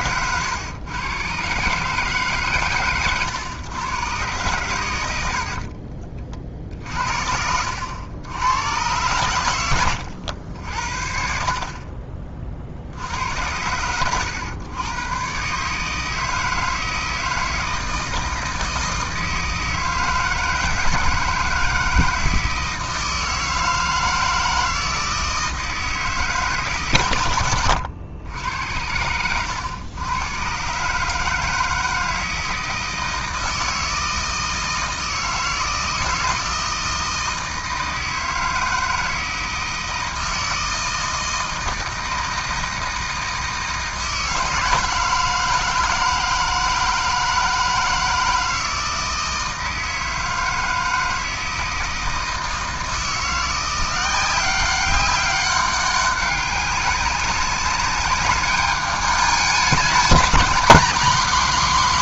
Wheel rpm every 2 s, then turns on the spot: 120, 120, 90, 60, 110, 60, 60, 110, 160, 160, 160, 160, 160, 130, 90, 130, 160, 160, 160, 160, 160, 160, 160, 160, 160, 160, 160, 190, 200, 210, 220.
none